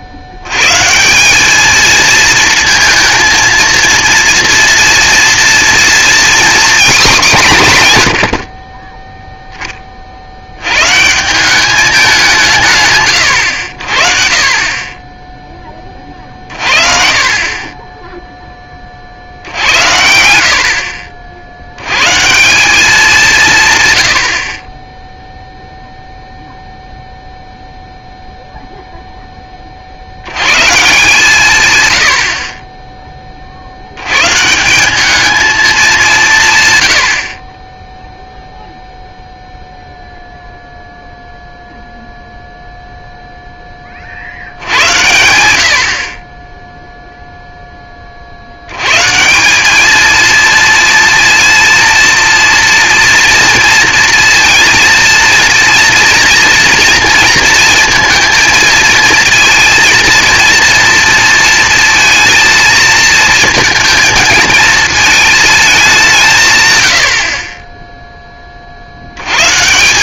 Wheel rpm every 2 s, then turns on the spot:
110, 230, 230, 240, 30, 100, 150, 20, 40, 20, 60, 190, 30, 0, 0, 110, 30, 180, 120, 0, 0, 0, 70, 20, 80, 230, 230, 230, 230, 220, 230, 230, 220, 130, 40.
none